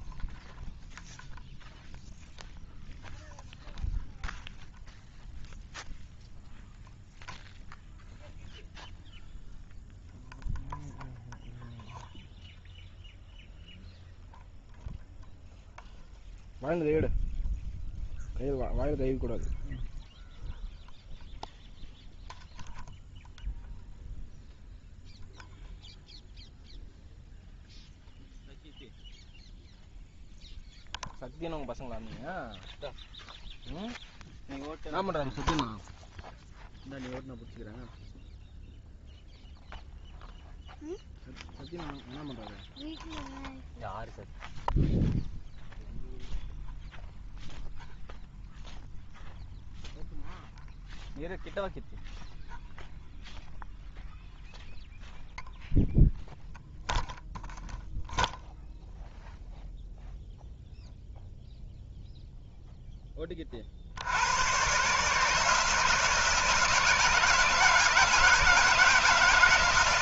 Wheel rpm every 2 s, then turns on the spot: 0, 0, 0, 0, 0, 0, 0, 0, 0, 0, 0, 0, 0, 0, 0, 0, 0, 0, 0, 0, 0, 0, 0, 0, 0, 0, 0, 0, 0, 0, 0, 0, 130, 160, 160.
none